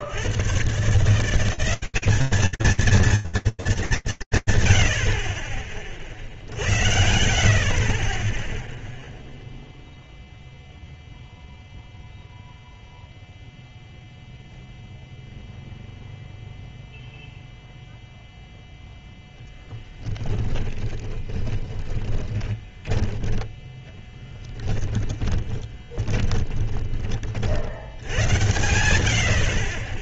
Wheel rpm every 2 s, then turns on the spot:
130, 230, 150, 60, 10, 0, 0, 0, 0, 10, 20, 10, 10, 30, 70.
20-22 24-26